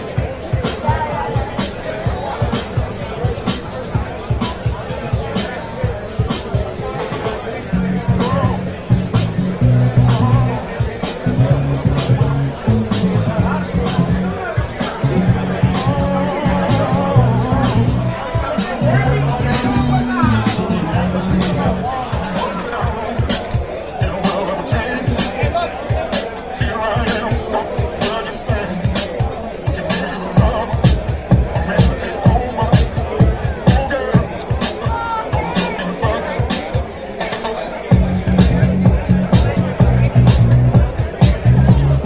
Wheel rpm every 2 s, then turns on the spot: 0, 0, 0, 0, 0, 0, 0, 0, 0, 0, 0, 0, 0, 0, 0, 0, 0, 0, 0, 0, 0.
none